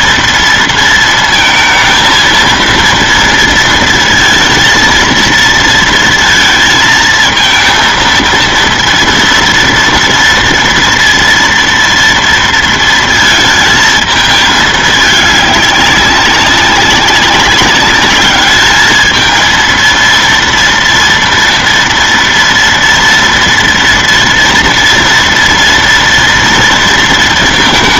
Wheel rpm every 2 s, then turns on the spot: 230, 230, 230, 230, 230, 230, 230, 220, 190, 210, 230, 230, 230, 230.
none